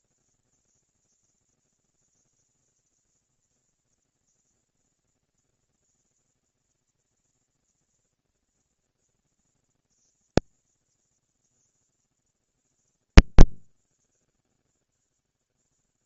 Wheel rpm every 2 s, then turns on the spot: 230, 230, 230, 230, 230, 210, 170, 160.
none